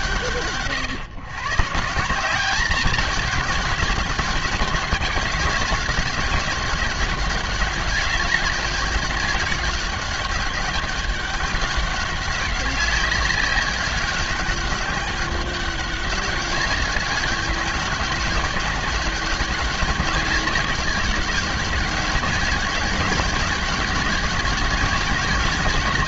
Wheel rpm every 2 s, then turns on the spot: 140, 210, 200, 200, 200, 200, 190, 200, 200, 200, 190, 200, 200.
none